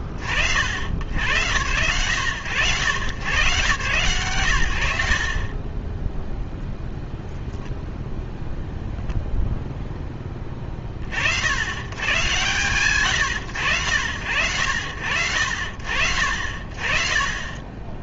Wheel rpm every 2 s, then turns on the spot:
40, 90, 80, 0, 0, 10, 130, 70, 60.
none